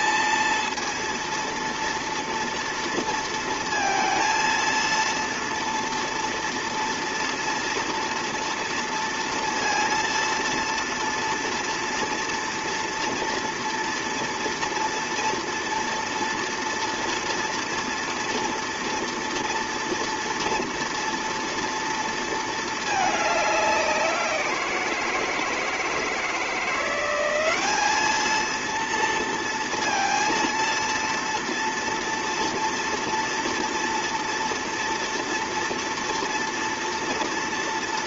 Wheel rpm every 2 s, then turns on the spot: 230, 230, 230, 230, 230, 230, 230, 230, 230, 230, 230, 220, 170, 170, 230, 230, 230, 230, 230.
none